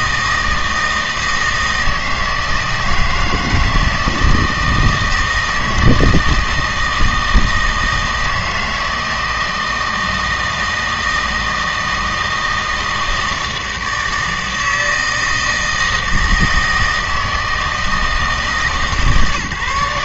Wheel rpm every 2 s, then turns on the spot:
160, 160, 160, 160, 160, 160, 160, 160, 160, 150.
none